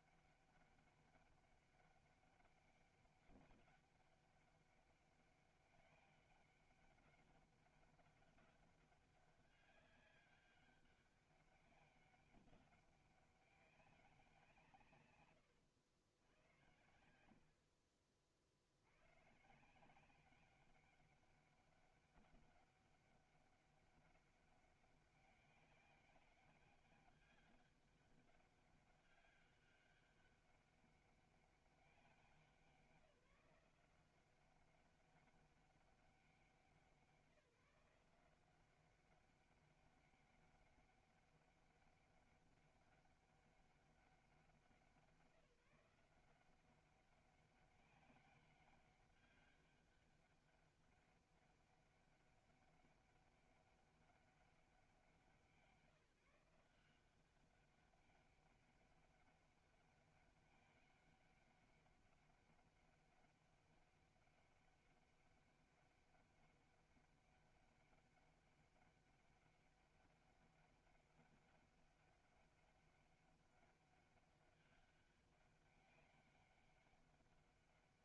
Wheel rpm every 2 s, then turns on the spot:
200, 200, 200, 200, 200, 200, 190, 160, 90, 70, 200, 200, 200, 200, 200, 200, 180, 190, 180, 190, 200, 200, 180, 190, 200, 200, 200, 190, 170, 200, 200, 200, 200, 200, 200, 200, 200, 200, 200.
none